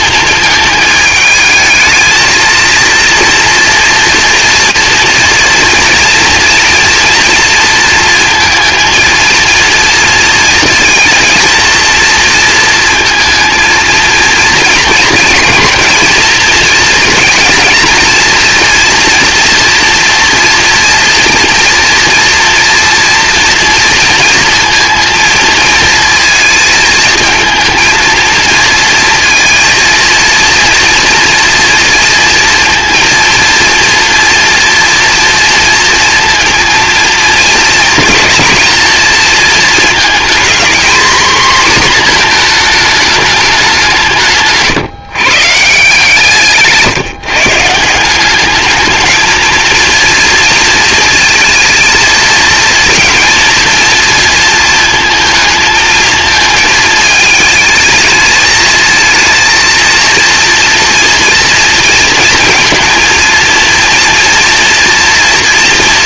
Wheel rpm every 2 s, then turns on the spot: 220, 230, 230, 230, 230, 230, 230, 230, 230, 230, 240, 230, 230, 230, 230, 230, 230, 230, 230, 230, 230, 220, 140, 160, 210, 230, 220, 230, 220, 220, 230, 230, 230.
none